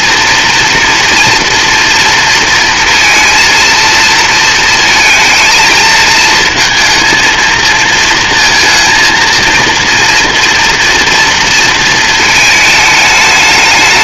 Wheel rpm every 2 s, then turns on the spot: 240, 230, 230, 230, 230, 230, 210.
none